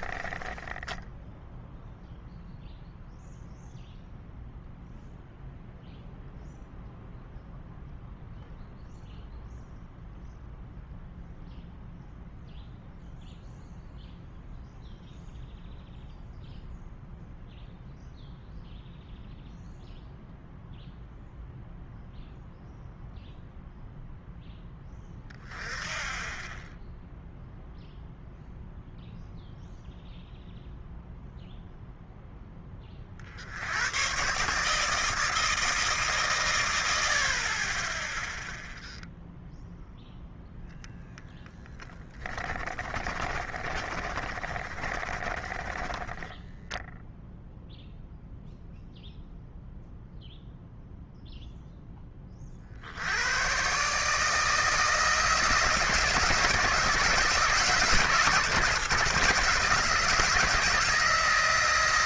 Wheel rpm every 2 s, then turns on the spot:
20, 0, 0, 0, 0, 0, 0, 0, 0, 0, 0, 0, 10, 10, 0, 0, 20, 150, 110, 0, 0, 20, 30, 10, 0, 0, 50, 160, 170, 150, 160.
0-2 42-48